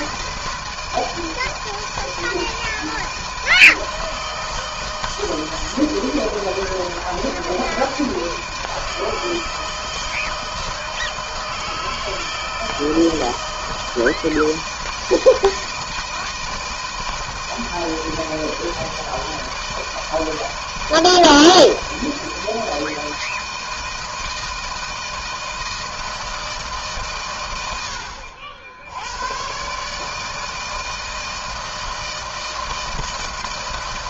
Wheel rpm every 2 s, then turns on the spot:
160, 160, 160, 160, 160, 160, 160, 160, 160, 160, 160, 160, 160, 130, 90, 160, 160.
none